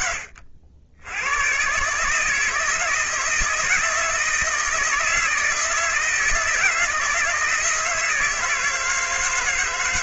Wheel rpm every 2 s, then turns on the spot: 80, 160, 160, 160, 160.
none